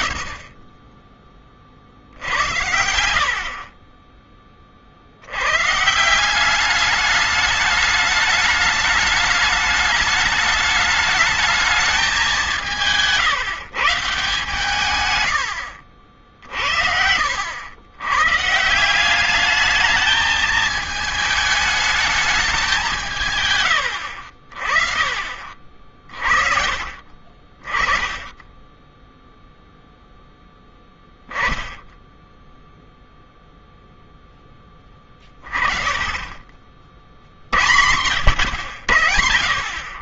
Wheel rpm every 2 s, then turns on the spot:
10, 80, 60, 200, 210, 210, 180, 120, 70, 170, 220, 190, 50, 30, 10, 0, 0, 20, 60, 90.
none